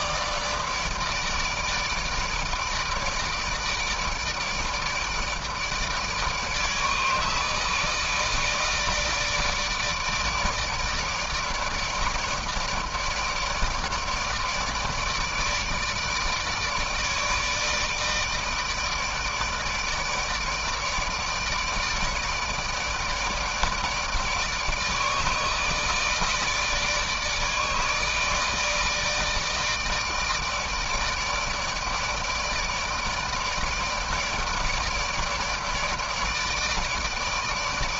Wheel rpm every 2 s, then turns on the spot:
150, 160, 150, 150, 160, 160, 160, 160, 160, 160, 150, 160, 160, 160, 150, 160, 150, 150, 160.
none